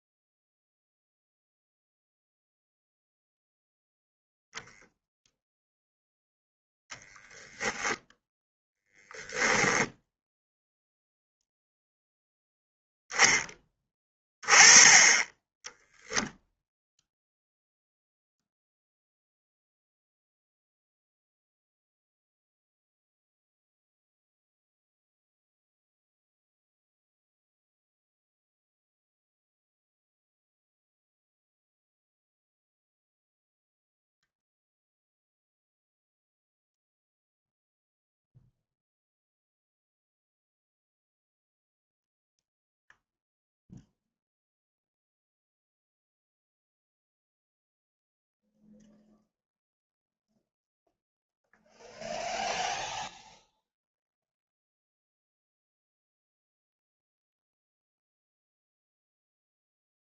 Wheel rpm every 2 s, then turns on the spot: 0, 0, 0, 10, 10, 0, 0, 20, 0, 0, 0, 0, 0, 0, 0, 0, 0, 0, 0, 0, 0, 0, 0, 0, 0, 0, 0, 0, 0, 0.
none